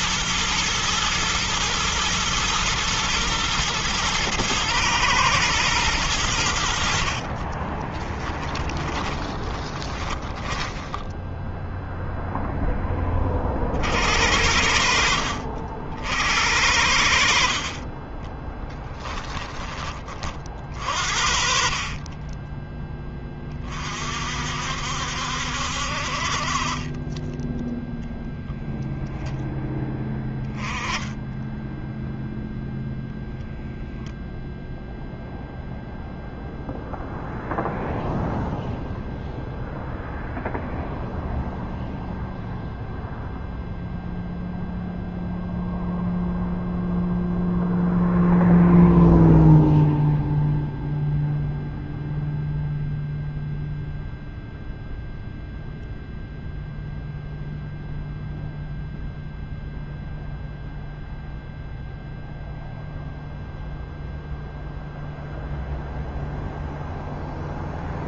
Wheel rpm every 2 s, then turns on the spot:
120, 120, 110, 90, 20, 20, 0, 60, 70, 20, 30, 20, 50, 50, 0, 10, 0, 0, 0, 0, 0, 0, 0, 0, 0, 0, 0, 0, 0, 0, 0, 0, 0, 0.
8-12 18-20 22-24